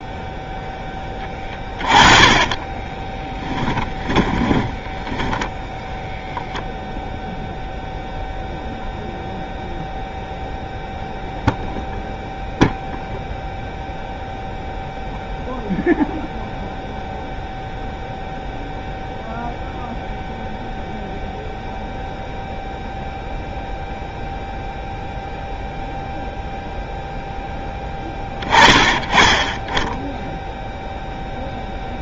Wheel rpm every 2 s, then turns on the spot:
0, 20, 20, 0, 0, 0, 0, 0, 0, 0, 0, 0, 0, 0, 20, 0.
2-6